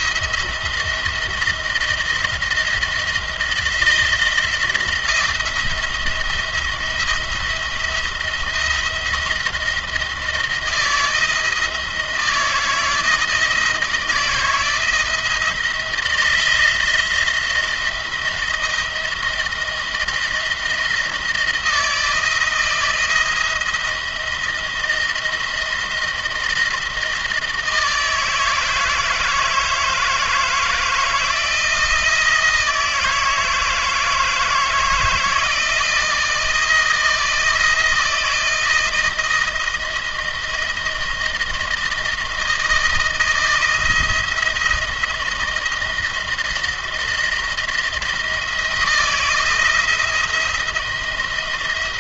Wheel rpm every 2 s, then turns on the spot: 170, 160, 170, 170, 170, 160, 160, 160, 170, 160, 160, 160, 160, 160, 160, 160, 160, 160, 160, 170, 170, 170, 170, 170, 170, 170.
none